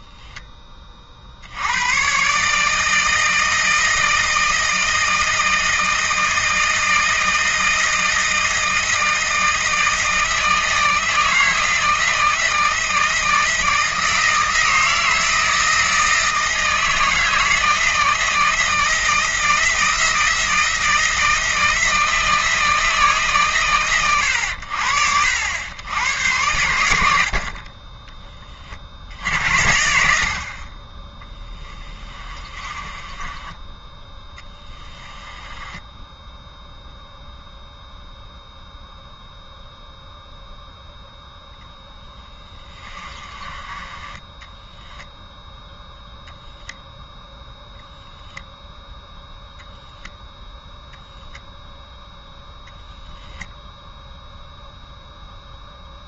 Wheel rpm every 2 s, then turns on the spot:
40, 160, 160, 160, 160, 160, 160, 160, 160, 160, 160, 150, 70, 70, 50, 20, 20, 10, 0, 0, 0, 20, 0, 0, 0, 0, 0, 0.
30-36 42-44